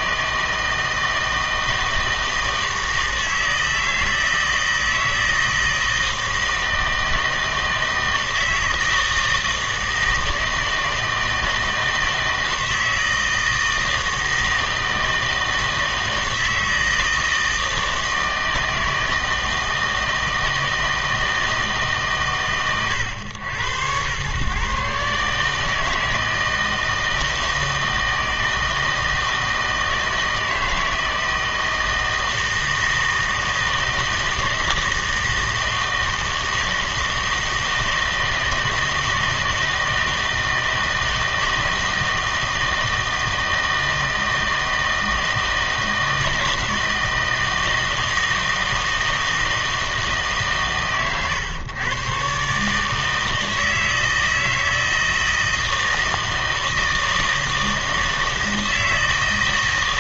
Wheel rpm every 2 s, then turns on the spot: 160, 160, 160, 160, 160, 160, 160, 160, 160, 160, 160, 110, 140, 160, 160, 160, 160, 160, 160, 160, 160, 160, 160, 160, 160, 120, 140, 160, 160, 160.
none